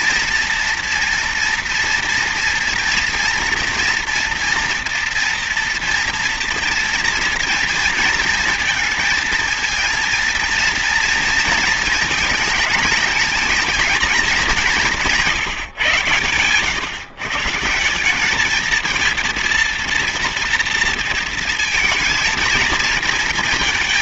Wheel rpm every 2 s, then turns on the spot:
240, 230, 230, 230, 230, 230, 220, 210, 120, 200, 230, 220.
none